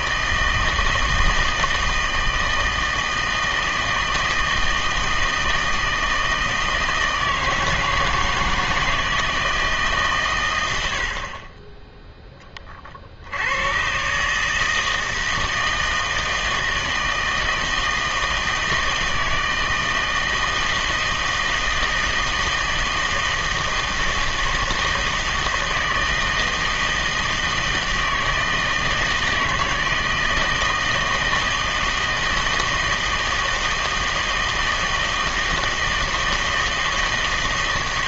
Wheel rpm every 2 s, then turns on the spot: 160, 160, 160, 160, 160, 90, 30, 160, 160, 160, 160, 160, 160, 160, 160, 160, 160, 160, 160.
none